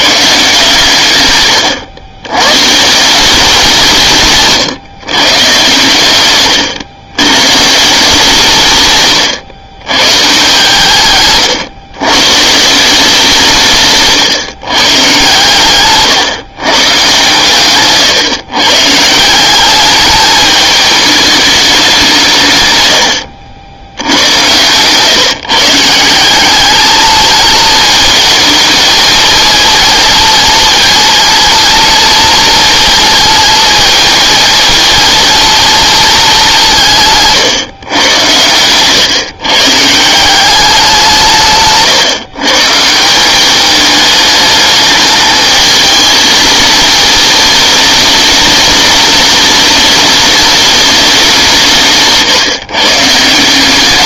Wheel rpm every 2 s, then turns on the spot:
140, 130, 140, 120, 160, 150, 160, 130, 130, 120, 210, 120, 120, 200, 220, 230, 230, 230, 190, 110, 190, 150, 210, 220, 210, 210, 150.
none